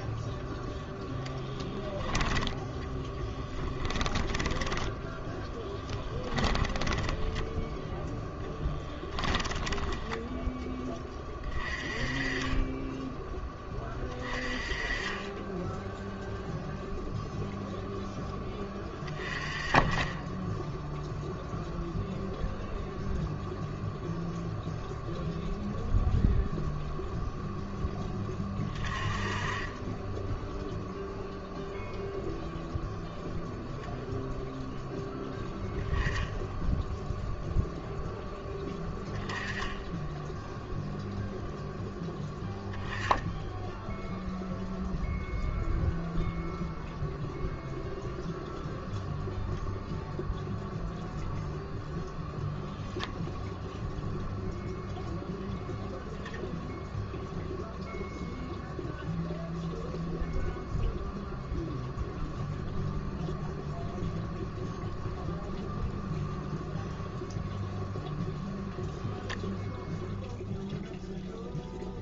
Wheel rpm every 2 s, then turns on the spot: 10, 10, 10, 10, 10, 10, 10, 20, 0, 20, 0, 0, 0, 0, 20, 0, 0, 0, 0, 10, 0, 10, 0, 0, 0, 0, 0, 0, 0, 0, 0, 0, 0, 0, 0, 0.
2-10